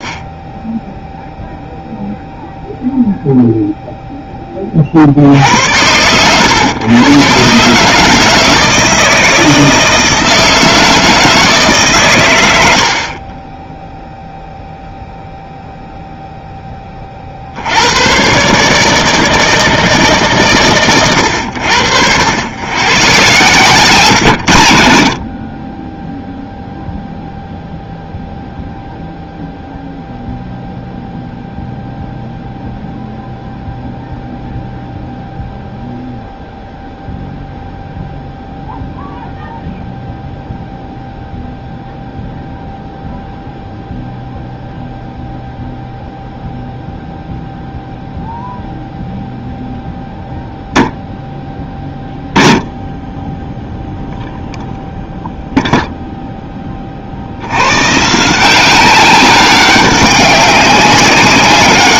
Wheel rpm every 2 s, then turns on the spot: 0, 0, 40, 120, 160, 160, 80, 0, 20, 150, 140, 110, 70, 0, 0, 0, 0, 0, 0, 0, 0, 0, 0, 0, 0, 0, 20, 0, 20, 190, 190.
none